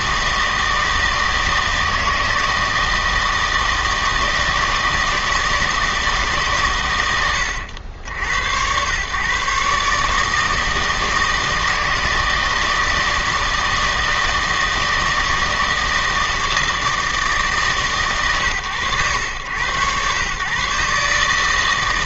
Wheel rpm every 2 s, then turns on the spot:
160, 160, 160, 120, 100, 160, 160, 160, 160, 110, 140.
none